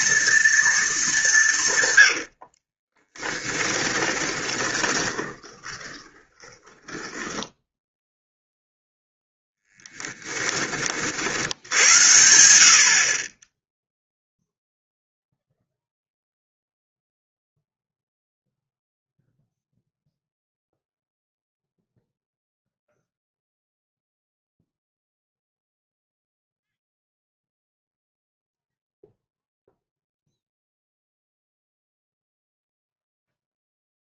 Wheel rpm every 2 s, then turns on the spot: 220, 30, 20, 10, 0, 30, 50, 0, 0, 0, 0, 0, 0, 0, 0, 0, 0.
2-8